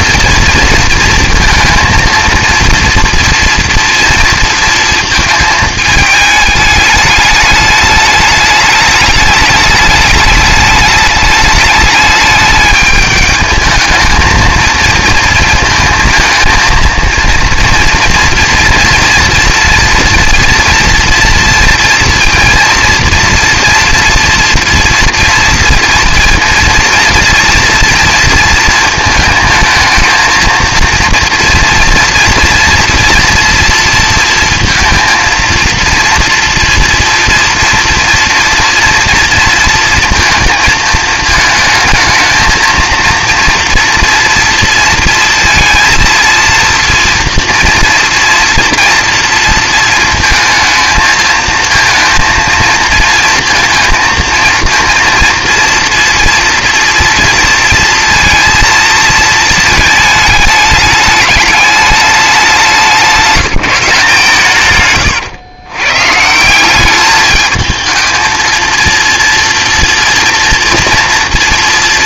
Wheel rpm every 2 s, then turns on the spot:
230, 230, 230, 210, 210, 210, 210, 220, 230, 240, 230, 230, 230, 230, 230, 230, 230, 230, 230, 230, 230, 230, 230, 230, 230, 220, 230, 230, 240, 230, 210, 190, 140, 180, 230, 230.
none